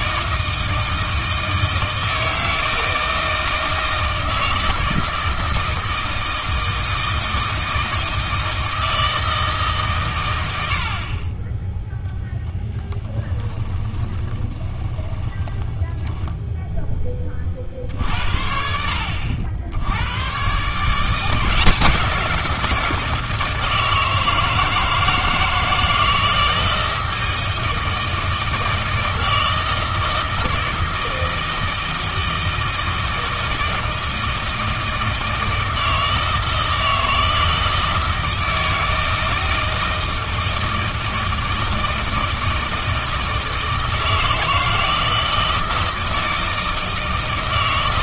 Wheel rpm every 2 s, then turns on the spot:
160, 160, 160, 160, 160, 70, 10, 30, 10, 70, 150, 170, 160, 160, 160, 160, 160, 160, 160, 160, 160, 160, 160, 160.
12-18